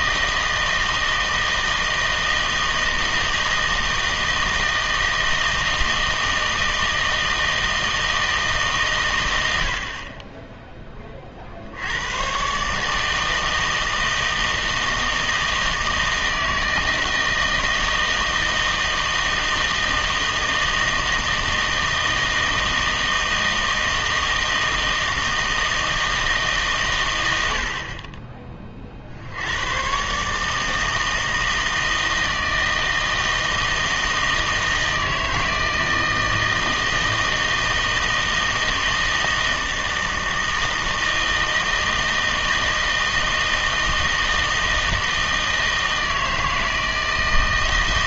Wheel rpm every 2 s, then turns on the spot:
160, 160, 160, 160, 150, 20, 140, 160, 160, 160, 160, 160, 160, 160, 30, 150, 160, 160, 160, 160, 160, 160, 160, 160.
none